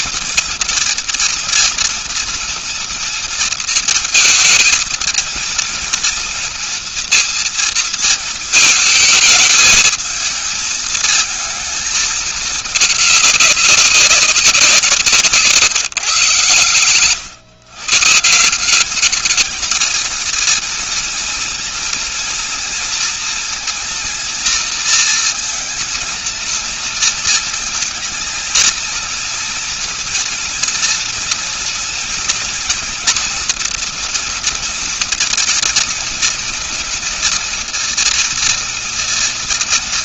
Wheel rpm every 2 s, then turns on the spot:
230, 230, 230, 230, 220, 220, 210, 190, 120, 170, 230, 230, 230, 230, 230, 230, 240, 230, 230, 230.
none